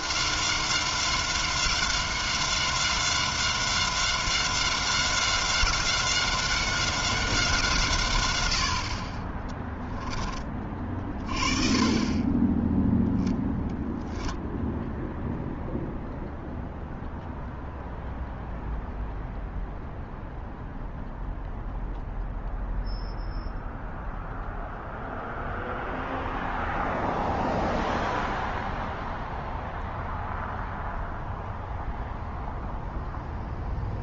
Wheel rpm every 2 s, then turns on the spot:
190, 190, 190, 180, 20, 30, 0, 0, 0, 0, 0, 0, 0, 0, 0, 0, 0.
none